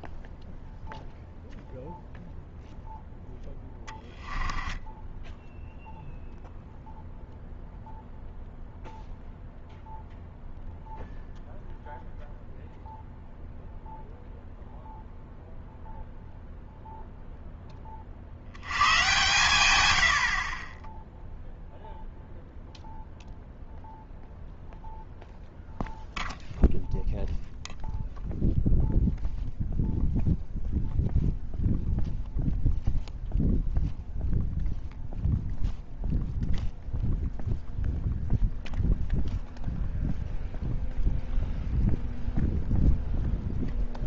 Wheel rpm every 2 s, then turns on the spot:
0, 0, 10, 0, 0, 0, 0, 0, 0, 90, 30, 0, 0, 0, 0, 0, 0, 0, 0, 0, 0, 0.
4-6